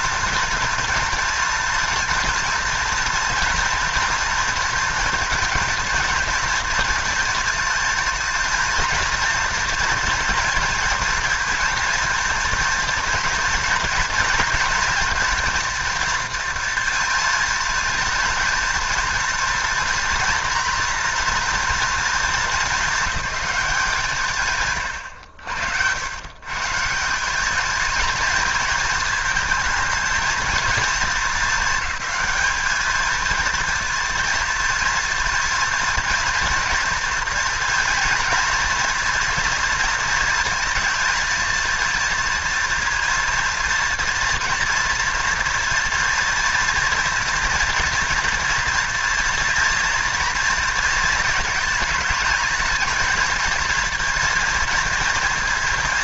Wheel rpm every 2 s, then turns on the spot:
230, 240, 230, 220, 230, 230, 230, 230, 230, 230, 230, 210, 130, 150, 220, 230, 220, 230, 230, 230, 230, 230, 240, 230, 230, 230, 220, 230.
24-26